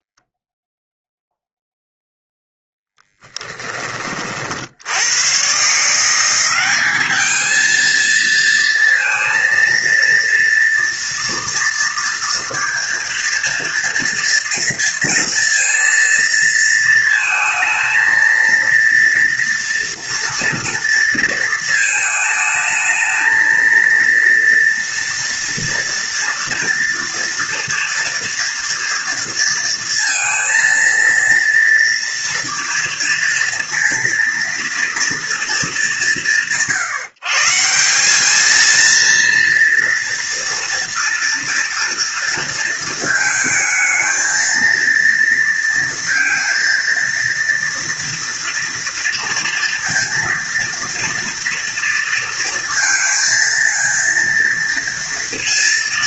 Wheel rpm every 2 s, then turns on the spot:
0, 10, 60, 190, 230, 230, 230, 230, 230, 230, 230, 220, 230, 230, 230, 230, 230, 230, 150, 230, 230, 230, 230, 230, 230, 230, 230, 230.
2-4